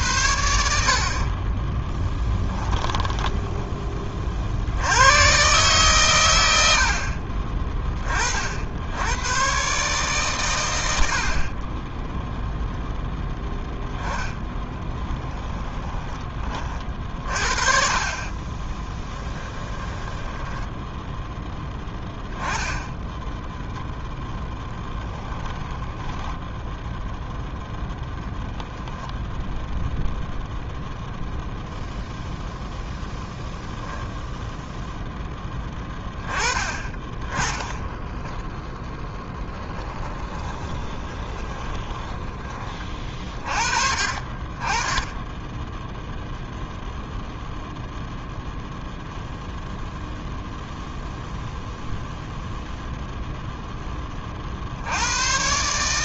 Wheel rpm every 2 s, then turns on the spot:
70, 10, 90, 70, 90, 80, 10, 10, 30, 20, 0, 10, 10, 0, 0, 0, 0, 0, 20, 0, 20, 30, 20, 0, 0, 0, 0, 70.
2-4 6-8 14-16 18-20 40-42